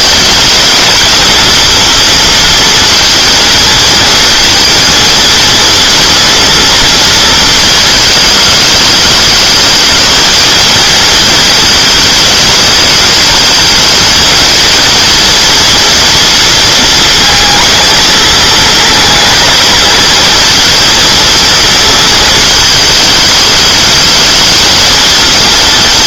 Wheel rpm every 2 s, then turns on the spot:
220, 230, 230, 230, 210, 220, 220, 220, 230, 220, 230, 220, 220.
none